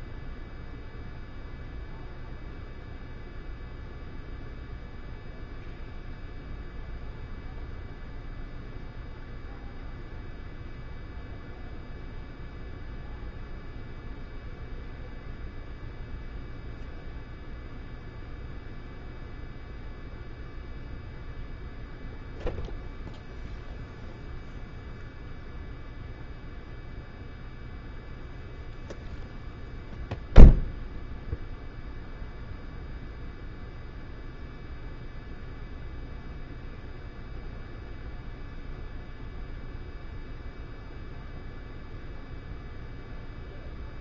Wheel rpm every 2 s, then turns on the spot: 0, 0, 0, 0, 0, 0, 0, 0, 0, 0, 0, 0, 0, 0, 0, 0, 0, 0, 0, 0, 0, 0.
none